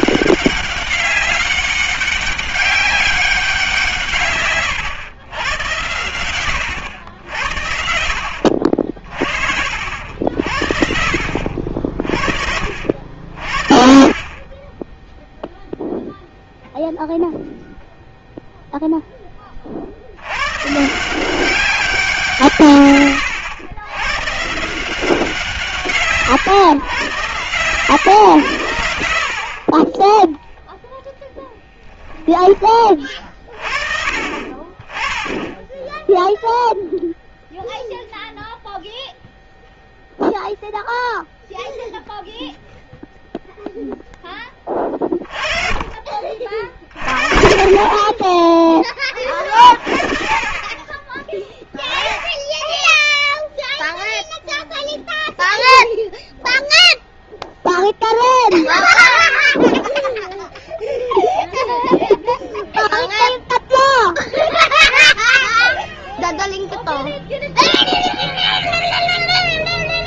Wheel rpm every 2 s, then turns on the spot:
200, 190, 120, 90, 60, 70, 60, 20, 0, 0, 130, 150, 160, 120, 100, 10, 20, 30, 0, 0, 0, 0, 20, 40, 20, 20, 10, 0, 0, 0, 0, 0, 0, 0, 0.
14-16